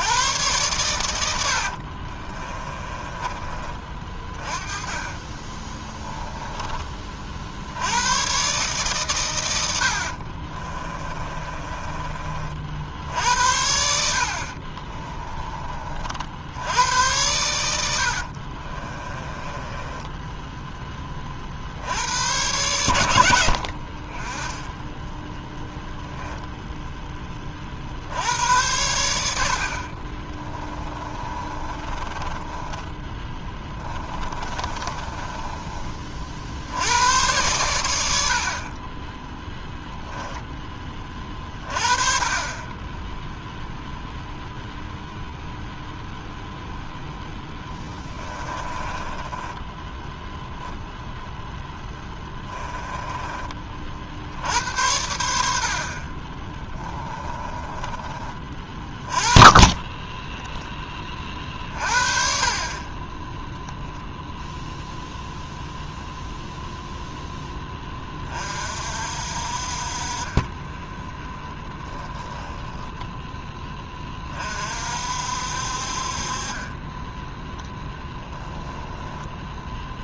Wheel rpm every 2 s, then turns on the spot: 110, 30, 20, 30, 130, 30, 60, 30, 90, 30, 20, 100, 10, 10, 80, 20, 20, 20, 90, 20, 20, 20, 0, 0, 10, 10, 10, 90, 20, 30, 30, 10, 0, 0, 50, 0, 10, 60, 10, 0.
2-4 10-12 14-16 18-20 30-36 48-50 52-54 56-58